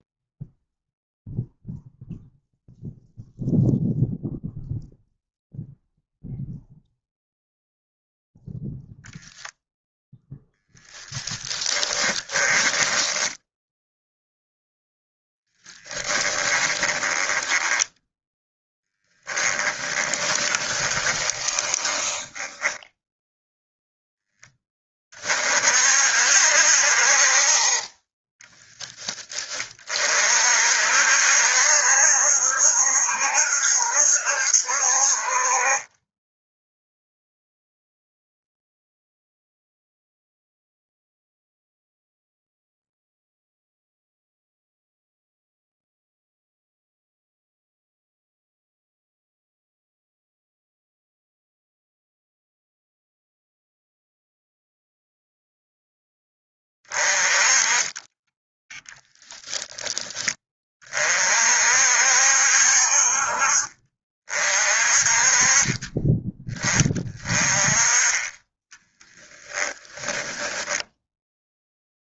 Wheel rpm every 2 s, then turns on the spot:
0, 0, 0, 0, 0, 10, 10, 0, 10, 20, 20, 10, 20, 60, 10, 60, 70, 60, 0, 0, 0, 0, 0, 0, 0, 0, 0, 0, 20, 0, 30, 50, 40, 20, 10, 0.
12-14 16-24 68-70